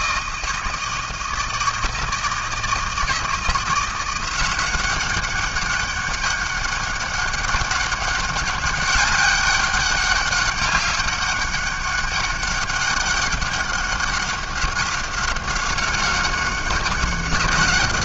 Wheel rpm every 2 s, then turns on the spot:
160, 160, 180, 200, 200, 200, 200, 190, 190.
none